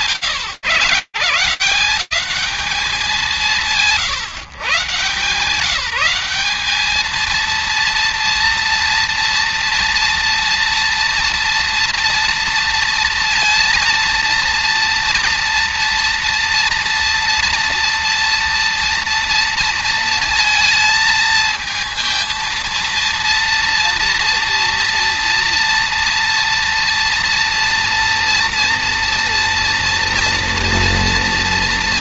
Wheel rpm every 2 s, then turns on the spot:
120, 140, 190, 230, 230, 240, 230, 230, 230, 230, 230, 230, 230, 240, 240, 230.
none